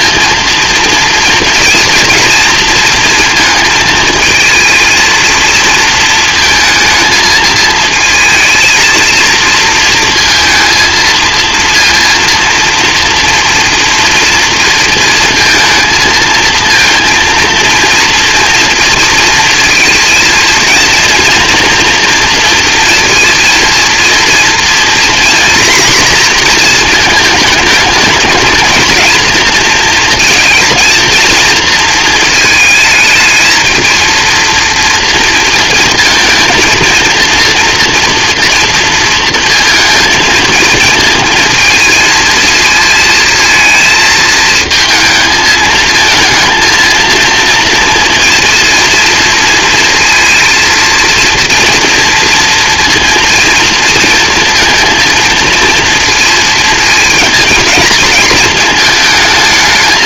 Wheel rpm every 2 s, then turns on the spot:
230, 230, 230, 220, 230, 230, 230, 230, 230, 230, 240, 230, 240, 220, 220, 230, 220, 230, 230, 230, 220, 220, 220, 230, 230, 230, 230, 230, 220, 220.
none